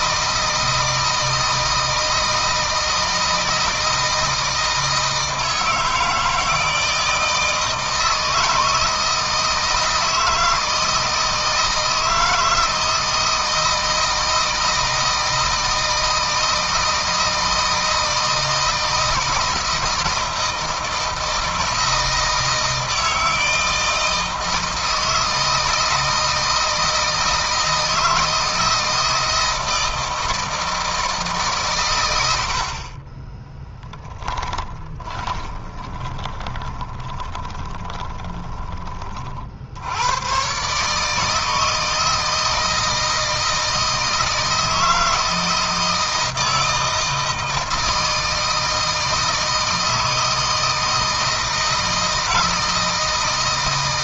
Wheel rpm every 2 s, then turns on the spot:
160, 160, 160, 160, 160, 160, 160, 160, 160, 160, 160, 160, 160, 160, 160, 160, 40, 20, 20, 30, 140, 160, 160, 160, 160, 160, 160.
34-38